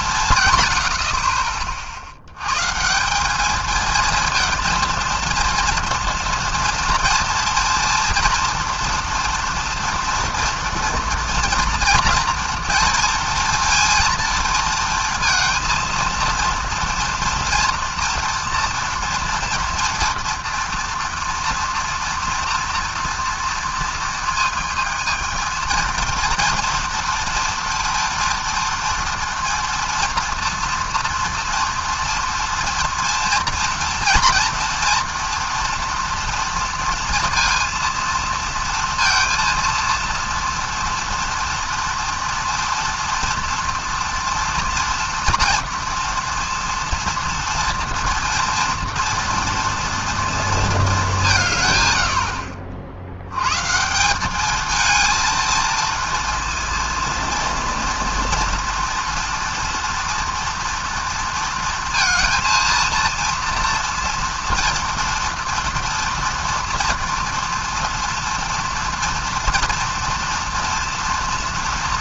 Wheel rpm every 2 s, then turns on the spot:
100, 150, 230, 230, 230, 230, 230, 220, 230, 230, 230, 230, 220, 230, 230, 230, 230, 240, 230, 230, 230, 230, 240, 230, 230, 210, 60, 220, 230, 230, 230, 230, 240, 230, 230, 230.
none